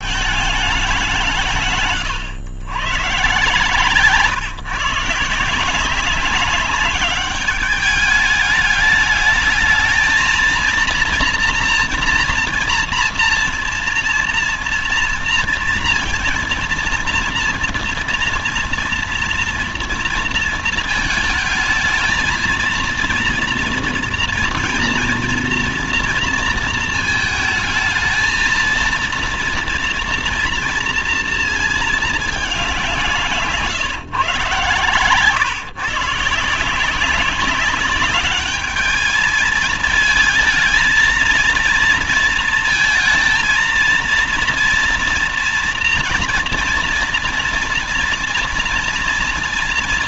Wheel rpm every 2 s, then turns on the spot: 210, 140, 160, 200, 210, 230, 240, 230, 230, 240, 230, 230, 230, 220, 230, 230, 200, 130, 170, 210, 220, 220, 230, 240, 230.
none